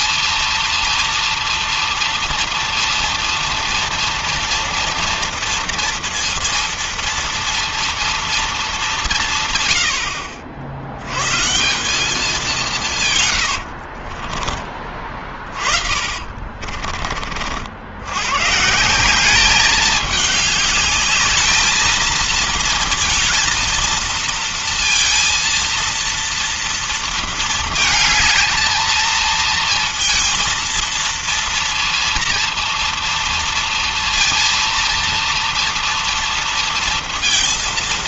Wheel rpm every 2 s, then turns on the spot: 230, 230, 230, 230, 180, 120, 120, 30, 40, 180, 210, 230, 230, 230, 230, 230, 230, 230, 230.
12-14